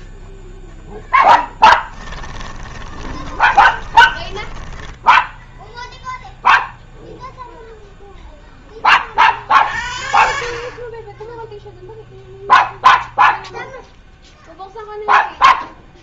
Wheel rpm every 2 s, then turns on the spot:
0, 20, 10, 0, 10, 50, 0, 0.
2-6